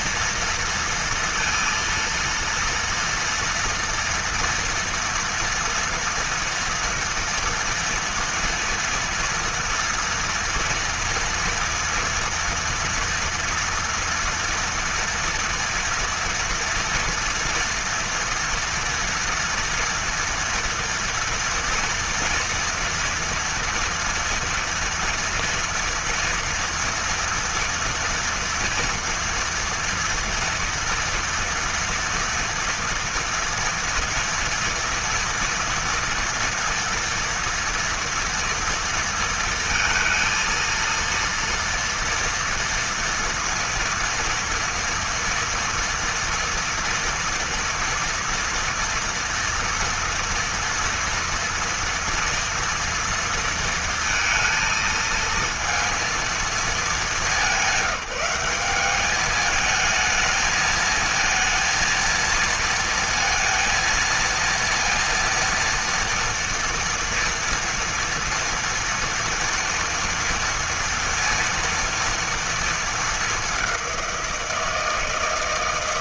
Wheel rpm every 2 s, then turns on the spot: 230, 230, 230, 230, 230, 230, 240, 230, 230, 230, 230, 230, 230, 230, 230, 230, 230, 230, 230, 230, 230, 240, 230, 230, 230, 230, 230, 220, 210, 190, 220, 230, 230, 230, 230, 230, 220, 170.
none